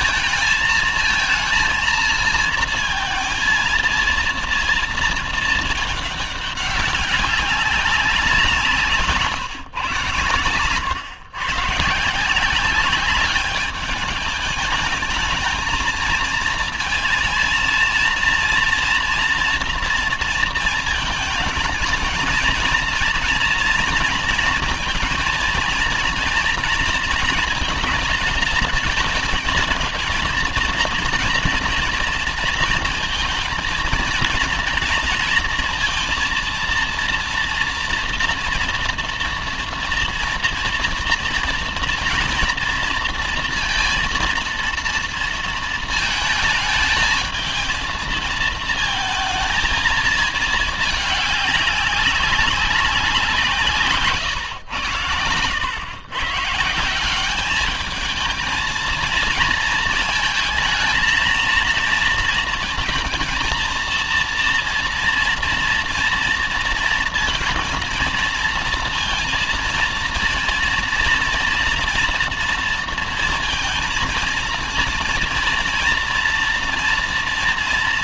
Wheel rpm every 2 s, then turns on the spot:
220, 230, 230, 200, 170, 110, 180, 210, 220, 230, 230, 240, 230, 230, 220, 230, 230, 230, 230, 230, 230, 230, 230, 220, 220, 220, 200, 110, 160, 220, 220, 220, 230, 230, 230, 230, 230, 230, 230.
none